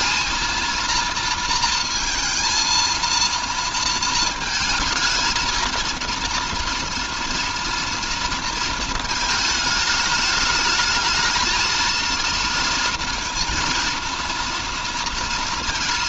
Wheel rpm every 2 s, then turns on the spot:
230, 230, 220, 230, 220, 220, 230, 230.
none